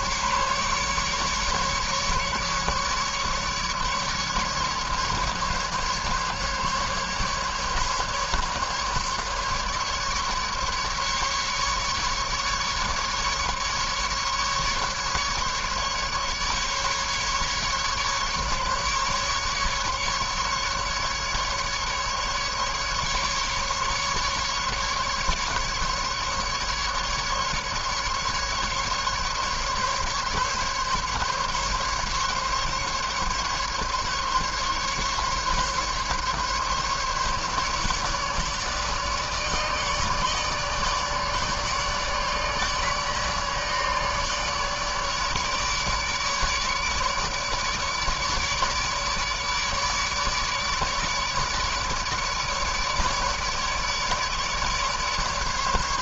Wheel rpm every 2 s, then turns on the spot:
140, 140, 140, 140, 150, 150, 150, 150, 140, 150, 150, 140, 150, 150, 150, 140, 140, 140, 140, 150, 150, 150, 150, 150, 150, 150, 150, 150.
none